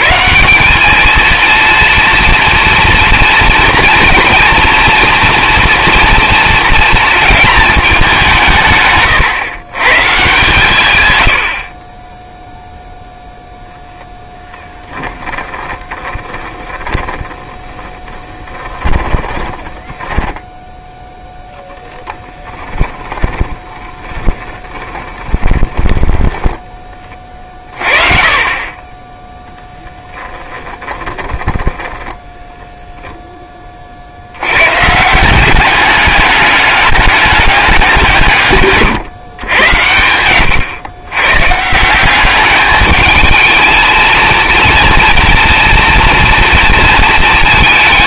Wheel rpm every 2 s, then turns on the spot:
150, 240, 230, 230, 160, 150, 0, 10, 20, 10, 10, 10, 20, 10, 30, 10, 0, 110, 200, 140, 110, 210, 230, 230.
14-26 30-32